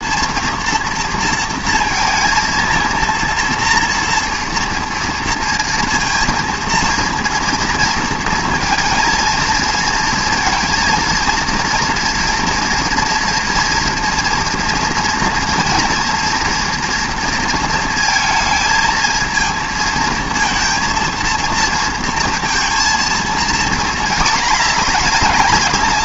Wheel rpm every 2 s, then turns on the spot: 230, 230, 230, 230, 230, 230, 230, 240, 240, 230, 230, 230, 220.
none